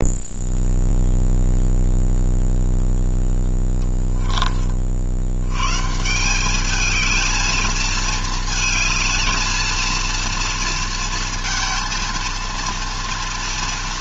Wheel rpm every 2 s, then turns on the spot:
0, 0, 60, 220, 220, 230, 230.
none